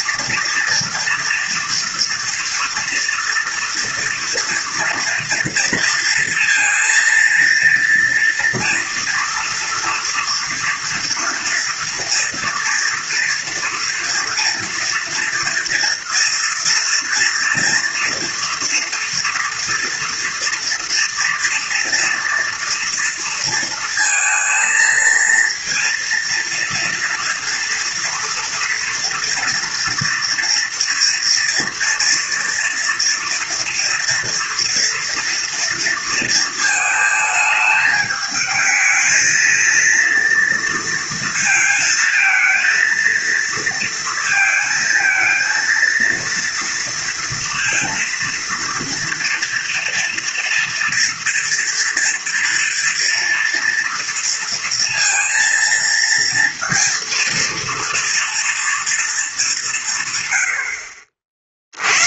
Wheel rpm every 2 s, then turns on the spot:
230, 240, 230, 230, 230, 230, 230, 230, 230, 230, 230, 230, 230, 230, 230, 240, 230, 230, 230, 210, 230, 220, 220, 230, 230, 230, 230, 230, 230, 230, 80.
none